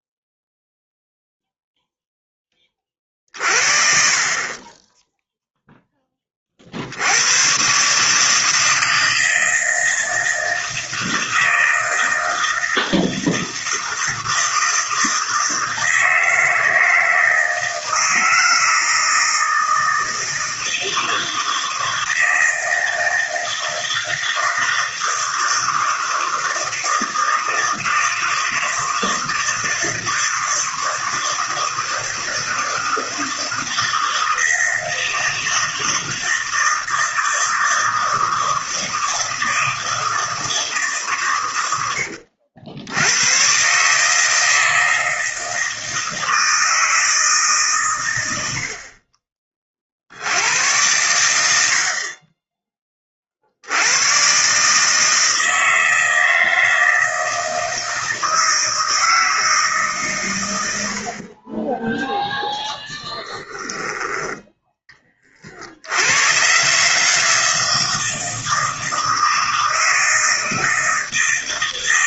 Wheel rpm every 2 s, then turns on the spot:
0, 30, 20, 60, 160, 160, 160, 160, 160, 160, 160, 160, 160, 160, 160, 160, 160, 160, 160, 160, 160, 80, 160, 160, 60, 90, 20, 150, 160, 160, 80, 0, 10, 140, 160, 160.
none